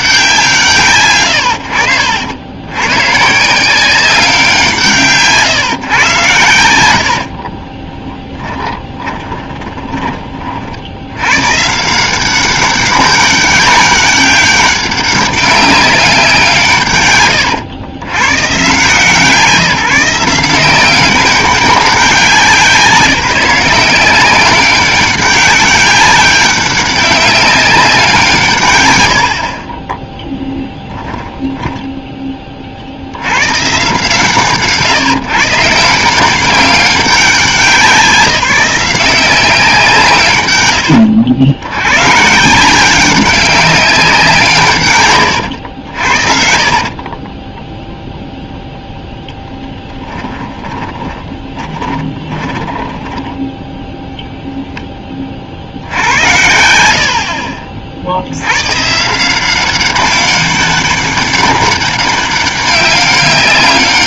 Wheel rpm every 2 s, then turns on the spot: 140, 100, 160, 80, 10, 60, 200, 200, 140, 140, 180, 180, 200, 200, 120, 10, 50, 140, 190, 180, 110, 170, 140, 50, 0, 20, 20, 10, 80, 130, 200, 200.
6-10 46-48 50-54